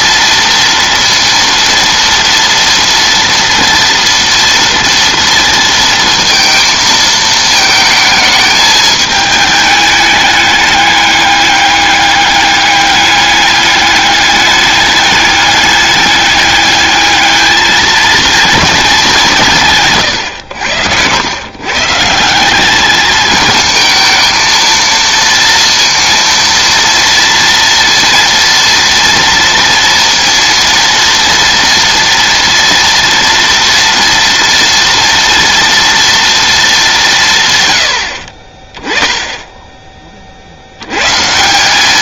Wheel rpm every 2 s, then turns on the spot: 230, 230, 230, 220, 210, 200, 200, 210, 210, 190, 100, 210, 230, 230, 230, 230, 230, 230, 190, 10, 130.
none